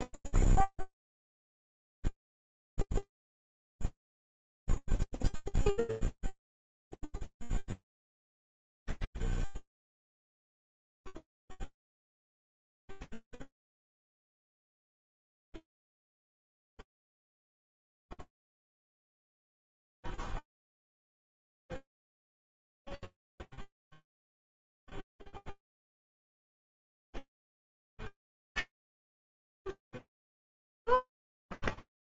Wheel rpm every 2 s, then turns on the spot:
0, 0, 0, 0, 0, 0, 0, 0, 0, 0, 0, 0, 0, 0, 80, 0.
none